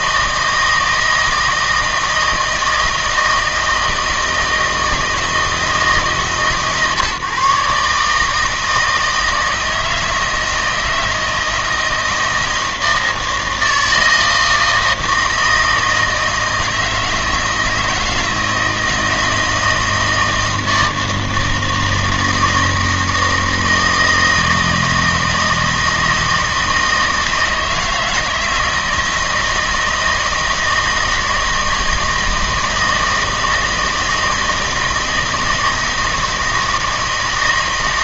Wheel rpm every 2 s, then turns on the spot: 160, 160, 160, 140, 160, 160, 160, 160, 160, 160, 160, 160, 160, 160, 160, 160, 160, 160, 160.
none